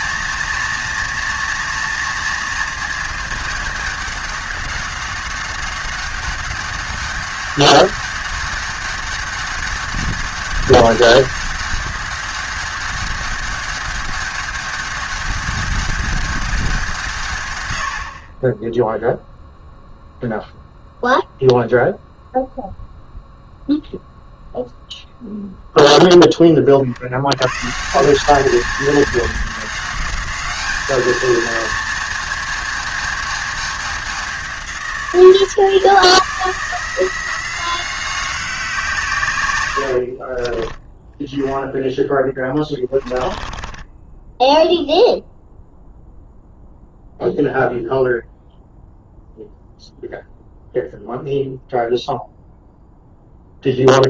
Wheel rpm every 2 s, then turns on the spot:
230, 220, 200, 200, 200, 200, 200, 200, 170, 0, 0, 0, 0, 50, 210, 210, 220, 170, 160, 160, 20, 20, 0, 0, 0, 0, 0.
42-44